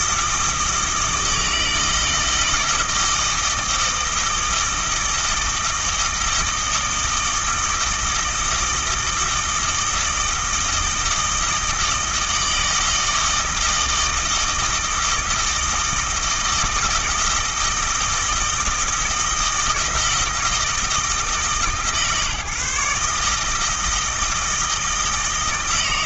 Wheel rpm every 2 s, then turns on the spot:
160, 160, 160, 160, 160, 160, 160, 160, 160, 160, 160, 150, 160.
none